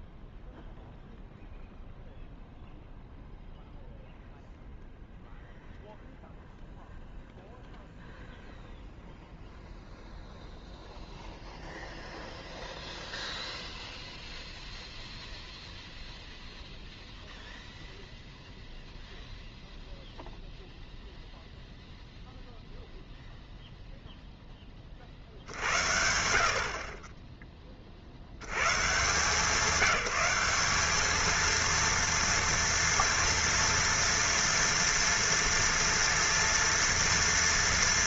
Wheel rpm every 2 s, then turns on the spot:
0, 0, 0, 0, 0, 0, 0, 0, 0, 0, 0, 0, 10, 70, 90, 190, 230, 230, 230.
none